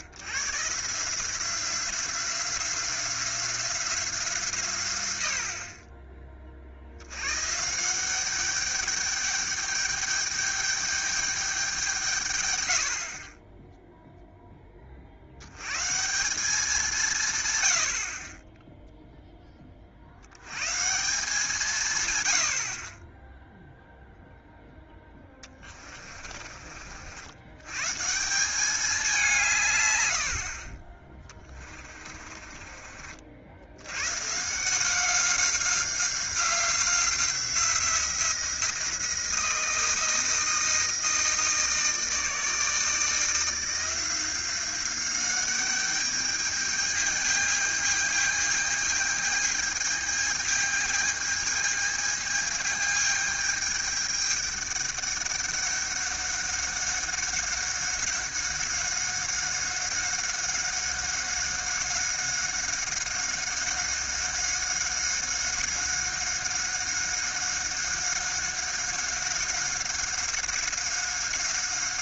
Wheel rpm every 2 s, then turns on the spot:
100, 180, 140, 40, 200, 210, 100, 20, 180, 10, 130, 70, 0, 40, 190, 50, 30, 160, 180, 170, 160, 160, 180, 210, 220, 220, 210, 200, 200, 190, 190, 190, 190, 190, 190, 190.
32-34